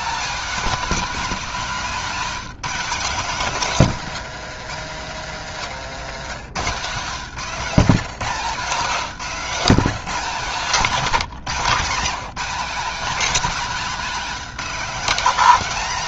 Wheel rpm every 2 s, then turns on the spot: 240, 220, 150, 180, 200, 200, 260, 250.
8-12